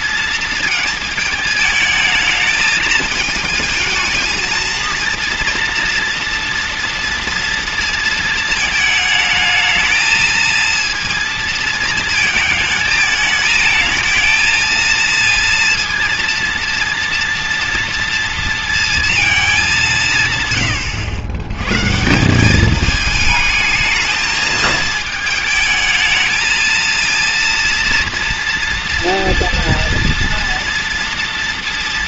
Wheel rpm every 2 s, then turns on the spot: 220, 220, 230, 230, 220, 230, 220, 230, 230, 230, 120, 210, 220, 230, 230, 230.
none